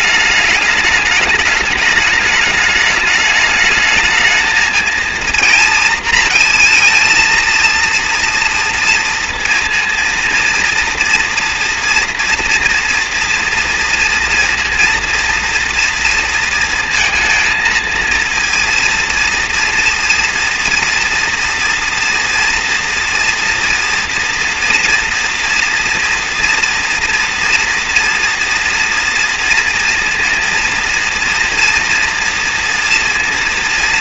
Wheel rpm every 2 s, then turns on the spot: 210, 210, 220, 230, 230, 230, 240, 230, 230, 230, 230, 230, 240, 230, 230, 230, 230.
none